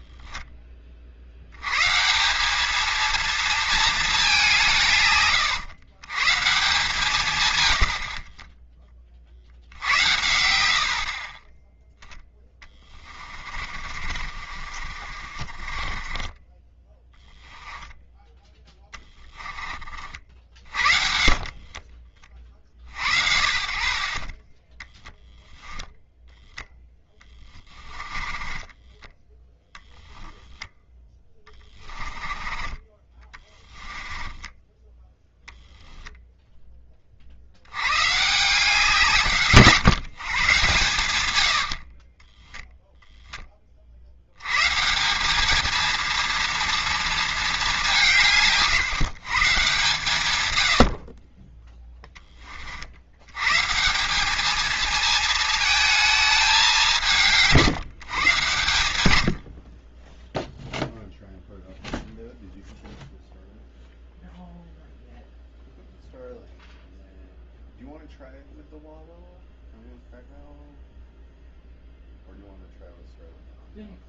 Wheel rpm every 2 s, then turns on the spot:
30, 220, 160, 150, 20, 50, 20, 40, 10, 20, 50, 50, 10, 10, 20, 10, 20, 10, 30, 160, 120, 10, 160, 230, 150, 60, 50, 220, 190, 100, 0, 0, 0, 0, 0, 0, 0.
12-16 18-22 26-32